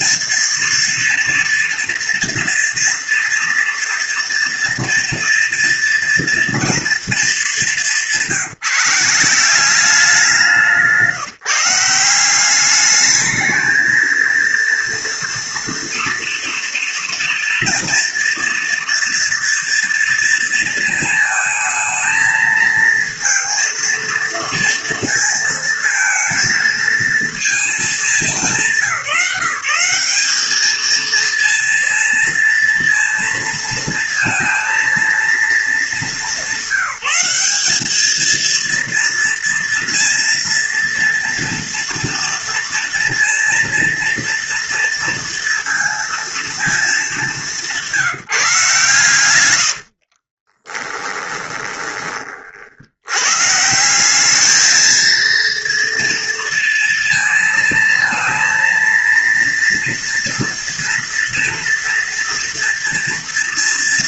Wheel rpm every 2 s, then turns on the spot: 230, 230, 230, 230, 170, 160, 210, 230, 230, 230, 220, 230, 230, 220, 170, 230, 230, 230, 200, 230, 230, 230, 230, 200, 130, 20, 100, 220, 230, 230, 230, 230.
50-52